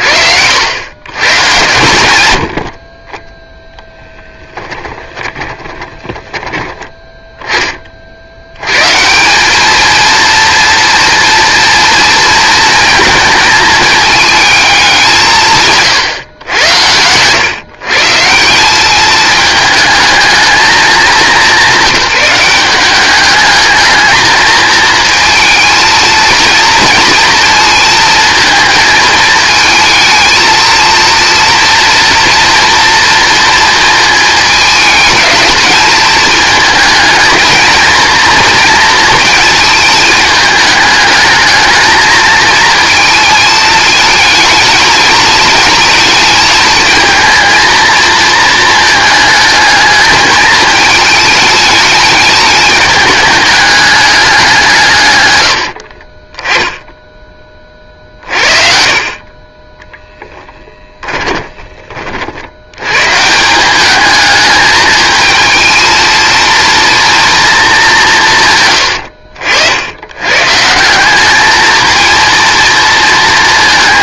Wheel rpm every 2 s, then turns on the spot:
90, 70, 10, 10, 120, 230, 230, 210, 110, 190, 220, 190, 220, 230, 220, 230, 240, 210, 220, 230, 220, 220, 220, 220, 220, 220, 210, 170, 10, 40, 20, 100, 220, 230, 110, 160, 230.
2-6 60-62